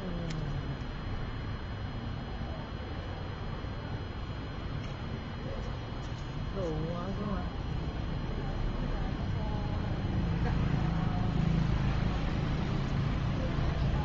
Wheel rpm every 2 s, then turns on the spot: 0, 0, 0, 0, 0, 0, 0.
none